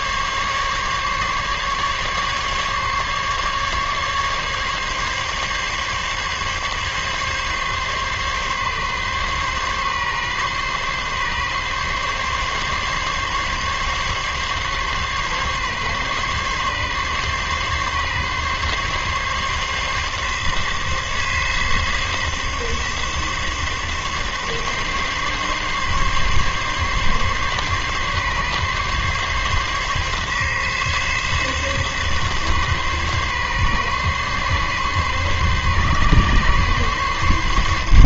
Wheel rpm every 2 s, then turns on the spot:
140, 140, 140, 140, 140, 140, 140, 140, 140, 140, 140, 140, 140, 140, 140, 140, 140, 140, 140.
none